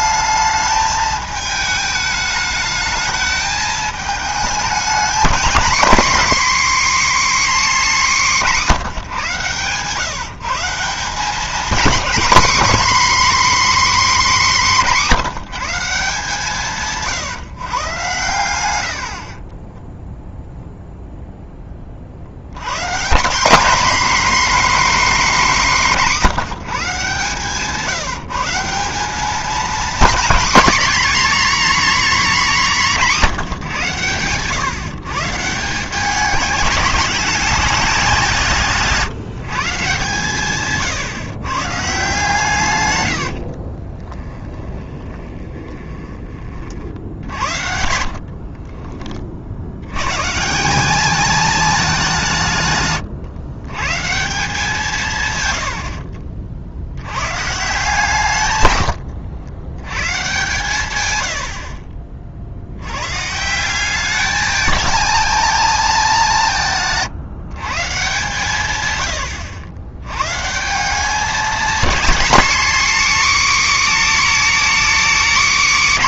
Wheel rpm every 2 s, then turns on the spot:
220, 210, 230, 280, 190, 170, 260, 220, 150, 90, 0, 120, 280, 170, 180, 260, 230, 130, 200, 160, 140, 120, 20, 40, 40, 190, 130, 170, 70, 110, 130, 80, 220, 160, 120, 170, 260, 280.
44-46 48-50